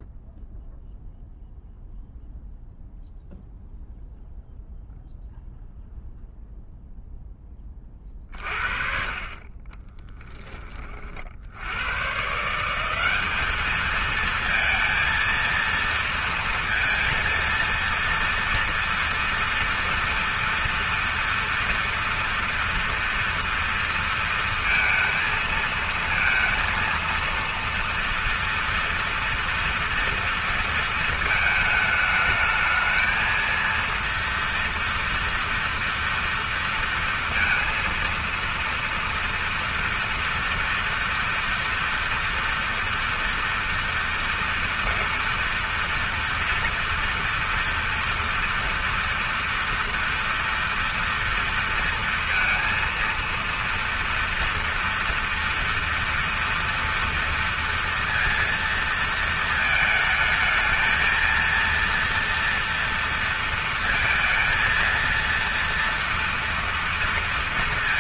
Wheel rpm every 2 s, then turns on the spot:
0, 0, 0, 0, 40, 20, 180, 230, 230, 230, 230, 240, 230, 230, 230, 230, 220, 240, 230, 230, 240, 230, 230, 230, 230, 230, 230, 230, 230, 230, 220, 230, 230, 230.
none